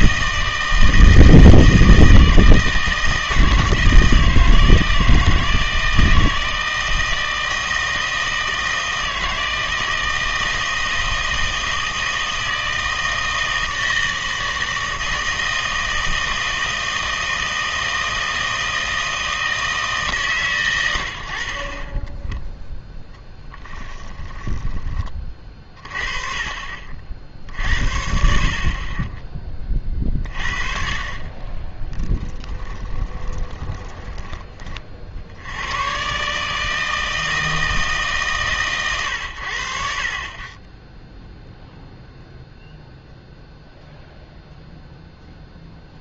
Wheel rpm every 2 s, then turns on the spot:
160, 160, 160, 160, 160, 160, 160, 160, 160, 160, 110, 0, 20, 40, 40, 40, 20, 40, 160, 120, 10, 0, 0.
32-34